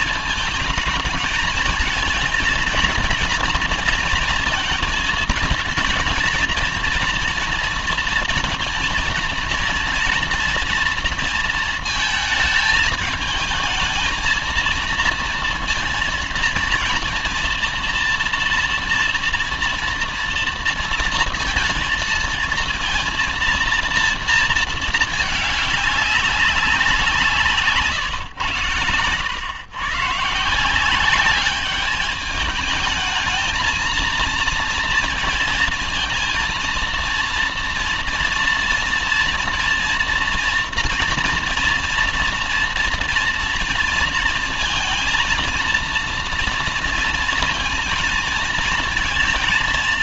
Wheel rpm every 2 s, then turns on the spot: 220, 230, 230, 230, 230, 230, 220, 230, 230, 230, 230, 220, 230, 190, 120, 150, 220, 230, 230, 230, 230, 230, 230, 230, 230.
none